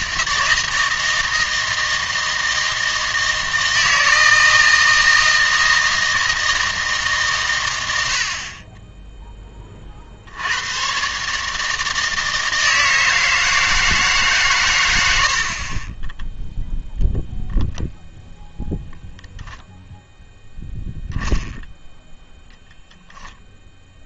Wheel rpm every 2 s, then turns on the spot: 160, 160, 160, 160, 20, 110, 160, 120, 0, 0, 0, 0.
none